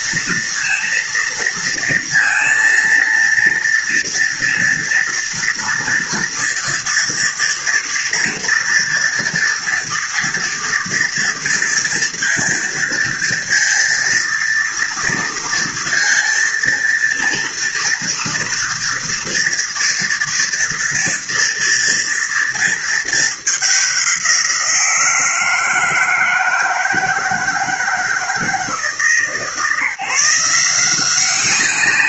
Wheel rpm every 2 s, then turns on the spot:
230, 230, 230, 230, 230, 230, 230, 230, 230, 240, 230, 220, 160, 160, 150, 180.
none